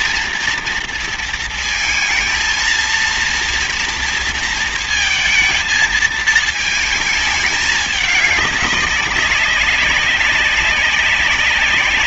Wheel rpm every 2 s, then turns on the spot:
230, 230, 230, 220, 200, 190.
none